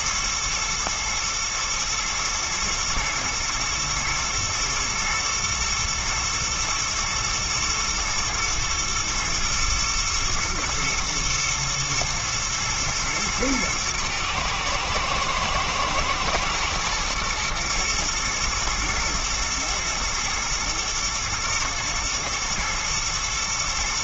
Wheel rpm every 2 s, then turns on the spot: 110, 110, 120, 110, 110, 120, 110, 110, 110, 120, 110, 110.
none